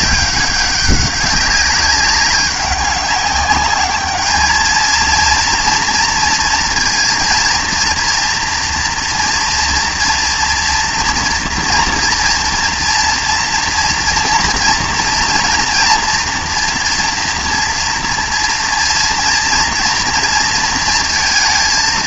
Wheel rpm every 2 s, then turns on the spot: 200, 200, 210, 230, 230, 240, 230, 230, 240, 230, 230.
none